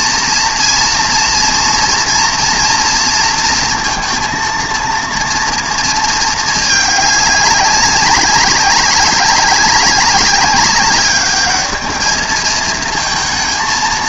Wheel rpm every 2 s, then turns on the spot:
230, 230, 230, 220, 190, 200, 220.
none